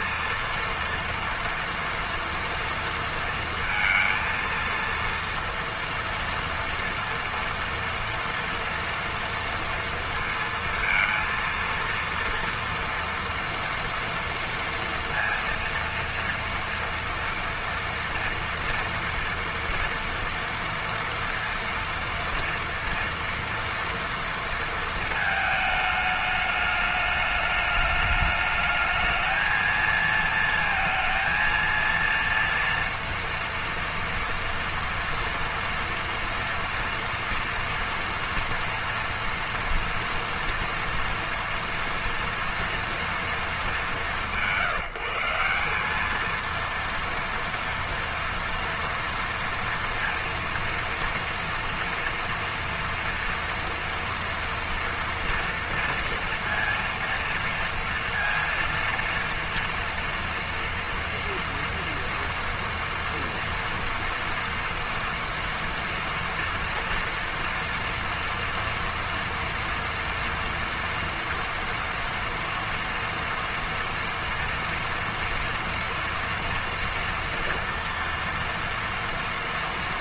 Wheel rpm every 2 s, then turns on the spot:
230, 230, 230, 230, 230, 230, 230, 230, 230, 230, 230, 230, 220, 210, 220, 230, 230, 230, 240, 230, 230, 230, 180, 230, 230, 230, 230, 230, 230, 230, 230, 230, 230, 230, 230, 230, 230, 230, 230, 230.
none